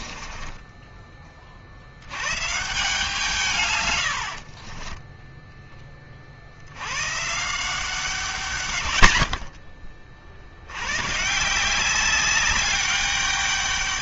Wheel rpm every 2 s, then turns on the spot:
30, 160, 10, 130, 50, 140, 200.
4-6